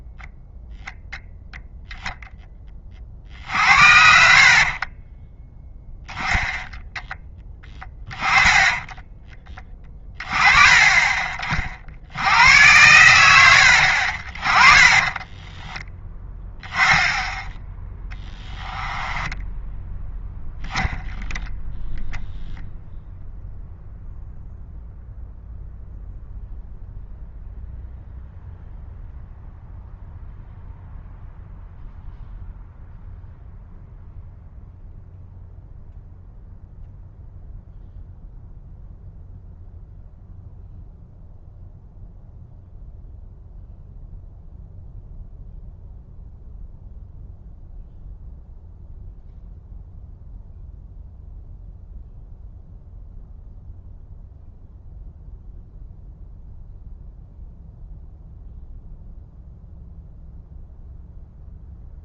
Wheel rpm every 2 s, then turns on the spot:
0, 20, 40, 10, 20, 20, 100, 30, 10, 10, 0, 0, 0, 0, 0, 0, 0, 0, 0, 0, 0, 0, 0, 0, 0, 0, 0, 0, 0, 0, 0.
4-6 8-10 14-16 18-20